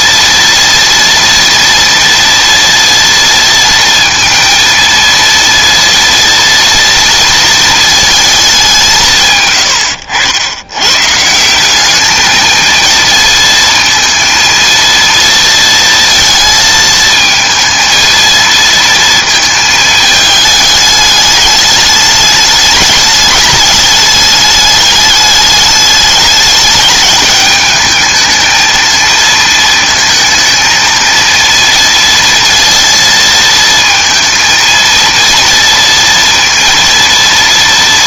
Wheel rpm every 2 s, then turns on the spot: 230, 230, 230, 230, 180, 110, 230, 230, 230, 230, 210, 210, 210, 210, 220, 230, 230, 230, 230.
none